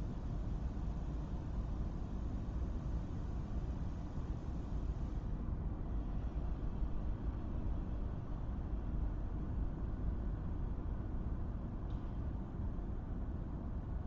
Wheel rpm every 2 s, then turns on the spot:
0, 0, 0, 0, 0, 0, 0.
none